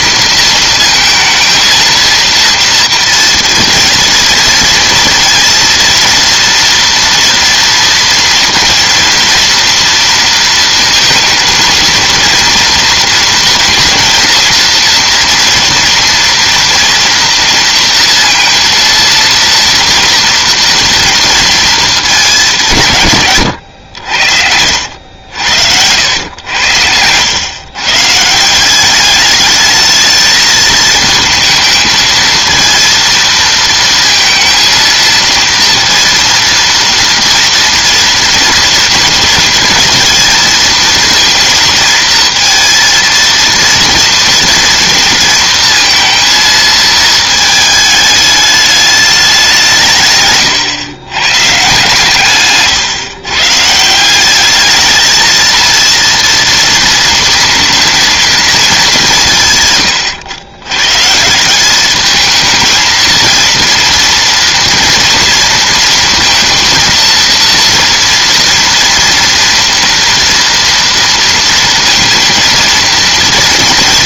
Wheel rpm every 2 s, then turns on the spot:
220, 230, 230, 230, 230, 230, 230, 230, 230, 230, 230, 140, 80, 90, 210, 220, 230, 230, 230, 230, 230, 230, 230, 220, 210, 130, 130, 220, 230, 200, 130, 230, 230, 230, 230, 230, 230.
none